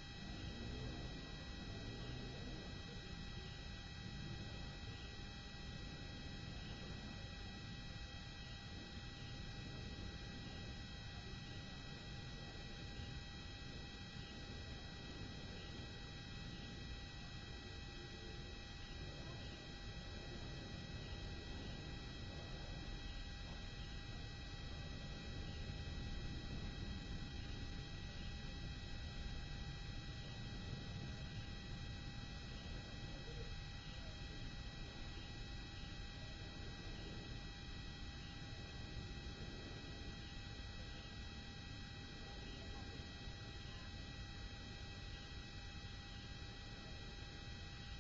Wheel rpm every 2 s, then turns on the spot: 0, 0, 0, 0, 0, 0, 0, 0, 0, 0, 0, 0, 0, 0, 0, 0, 0, 0, 0, 0, 0, 0, 0, 0.
none